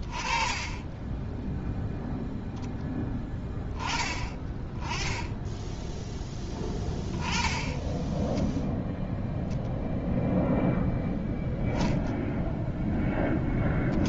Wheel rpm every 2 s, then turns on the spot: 30, 0, 20, 10, 0, 0, 0.
none